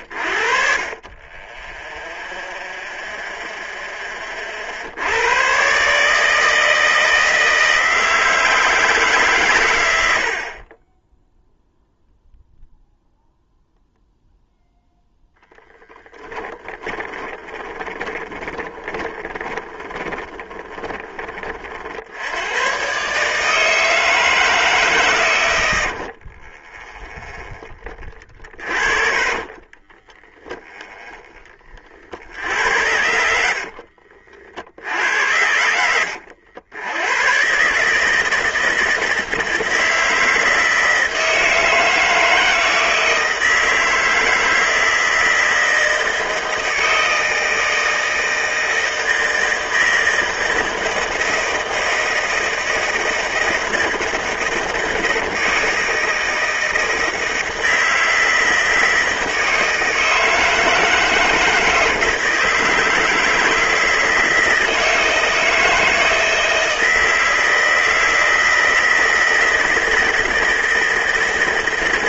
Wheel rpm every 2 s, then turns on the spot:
30, 0, 80, 160, 140, 10, 0, 0, 20, 20, 30, 130, 130, 20, 40, 10, 60, 70, 100, 160, 160, 160, 160, 160, 160, 160, 160, 160, 160, 160, 160, 160, 160, 160, 160, 160.
16-20 26-30